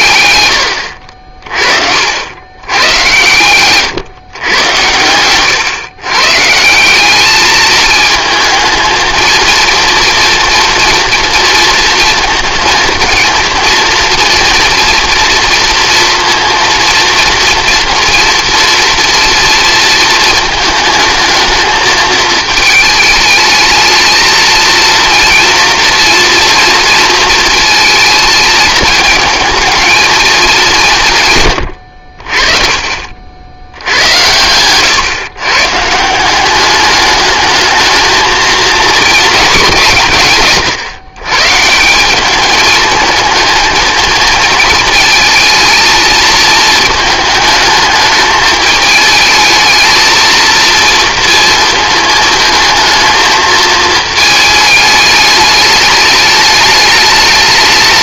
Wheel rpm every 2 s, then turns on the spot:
90, 100, 110, 170, 230, 230, 230, 240, 230, 230, 220, 220, 220, 230, 220, 200, 40, 110, 200, 220, 140, 210, 230, 220, 210, 230, 220, 210, 210.
none